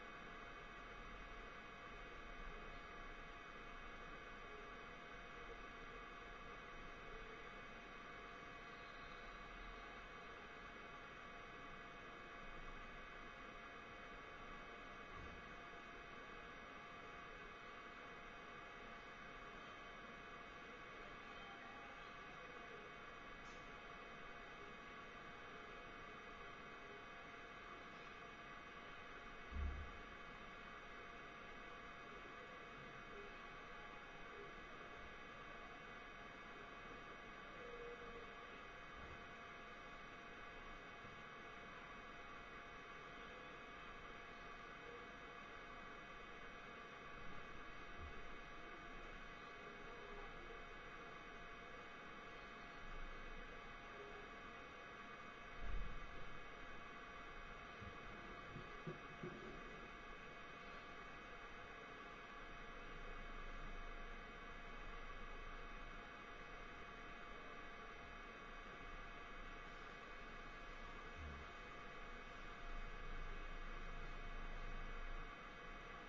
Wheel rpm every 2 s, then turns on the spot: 0, 0, 0, 0, 0, 0, 0, 0, 0, 0, 0, 0, 0, 0, 0, 0, 0, 0, 0, 0, 0, 0, 0, 0, 0, 0, 0, 0, 0, 0, 0, 0, 0, 0, 0, 0, 0, 0.
none